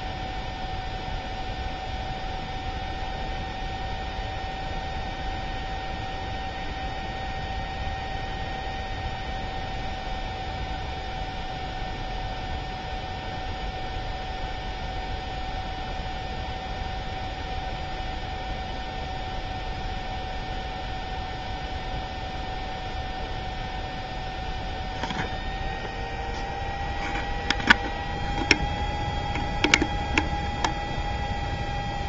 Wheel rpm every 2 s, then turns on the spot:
0, 0, 0, 0, 0, 0, 0, 0, 0, 0, 0, 0, 0, 0, 0, 0.
none